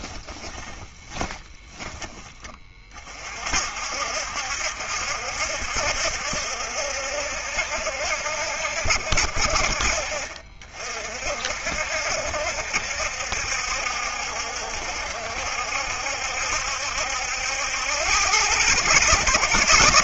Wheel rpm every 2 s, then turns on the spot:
20, 30, 70, 70, 70, 50, 60, 70, 70, 100.
0-2